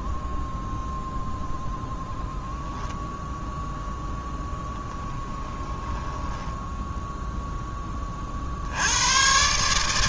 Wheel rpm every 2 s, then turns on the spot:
0, 0, 10, 10, 80.
4-8